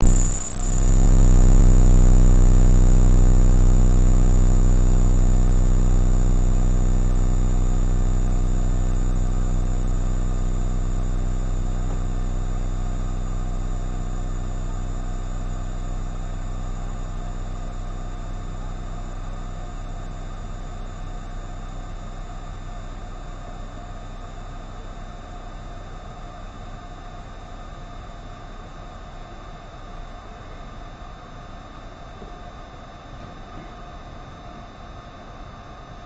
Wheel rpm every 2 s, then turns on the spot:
0, 0, 0, 0, 0, 0, 0, 0, 0, 0, 0, 0, 0, 0, 0, 0, 0, 0.
none